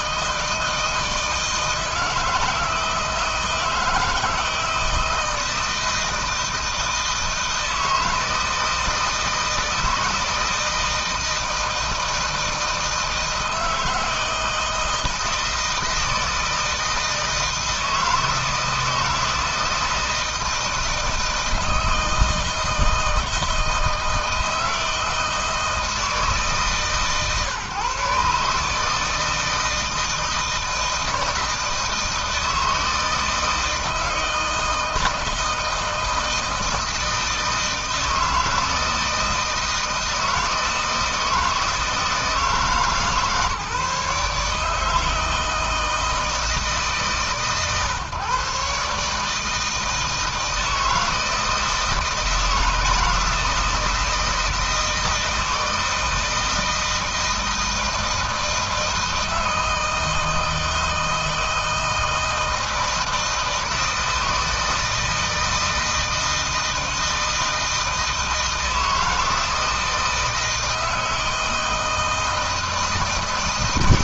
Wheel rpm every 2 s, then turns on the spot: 160, 160, 160, 160, 160, 160, 160, 160, 160, 160, 160, 160, 160, 160, 150, 160, 160, 160, 160, 160, 160, 160, 150, 160, 140, 160, 160, 160, 160, 160, 160, 160, 160, 160, 160, 160, 160.
none